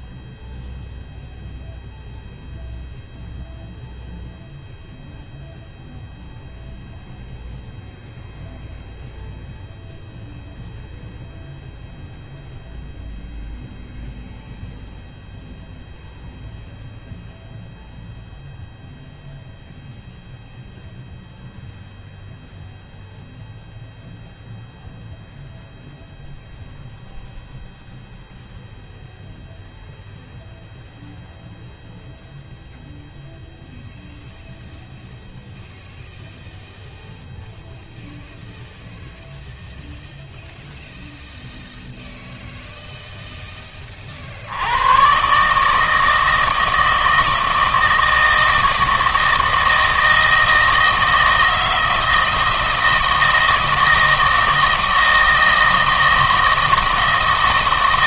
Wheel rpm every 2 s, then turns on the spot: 0, 0, 0, 0, 0, 0, 0, 0, 0, 0, 0, 0, 0, 0, 0, 0, 0, 0, 0, 0, 0, 0, 90, 160, 160, 160, 160, 160, 160.
none